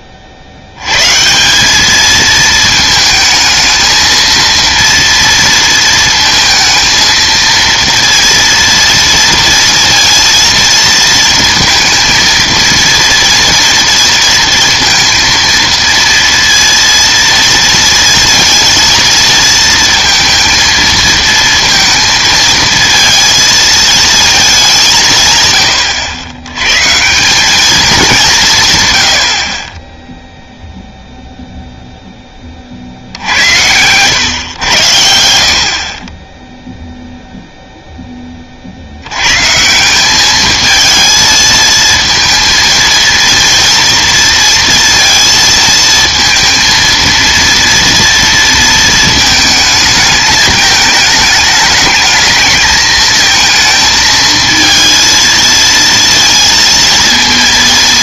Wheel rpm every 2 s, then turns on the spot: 80, 220, 230, 220, 230, 230, 230, 230, 230, 230, 230, 230, 210, 90, 150, 0, 40, 100, 0, 50, 220, 230, 230, 230, 230, 210, 220, 230, 230.
none